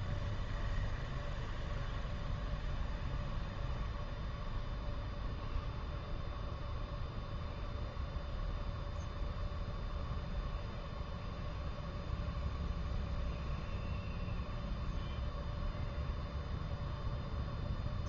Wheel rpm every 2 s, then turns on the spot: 0, 0, 0, 0, 0, 0, 0, 0, 0.
none